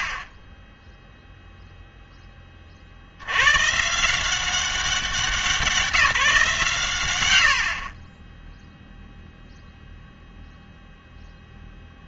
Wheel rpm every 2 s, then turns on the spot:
20, 40, 190, 140, 0, 0.
none